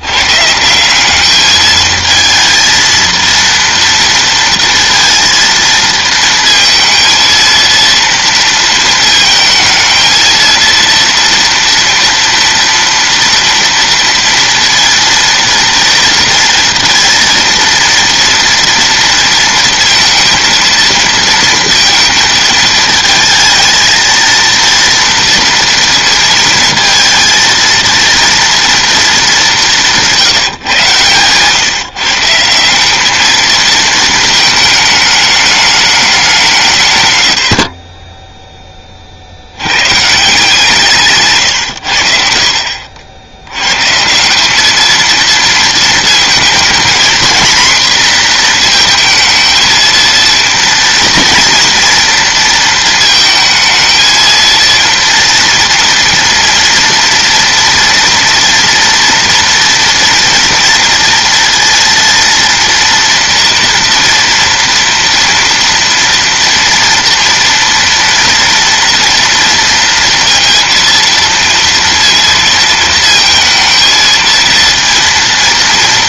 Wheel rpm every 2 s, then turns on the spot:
170, 230, 230, 230, 230, 230, 230, 230, 230, 230, 230, 220, 230, 230, 230, 140, 170, 220, 170, 10, 160, 60, 210, 230, 230, 230, 230, 230, 230, 230, 240, 230, 230, 230, 230, 230, 230, 230.
none